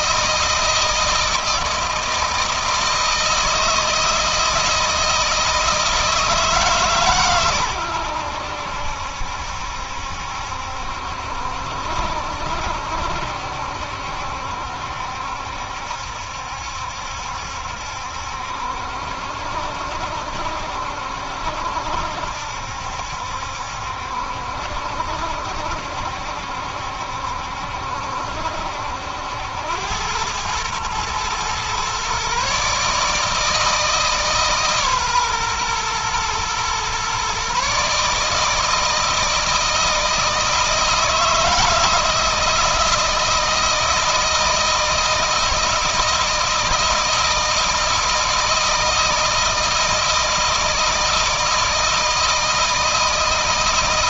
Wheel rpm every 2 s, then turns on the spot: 160, 160, 160, 150, 80, 70, 70, 70, 70, 70, 70, 70, 70, 70, 70, 110, 150, 140, 120, 160, 160, 160, 160, 160, 160, 160, 160.
none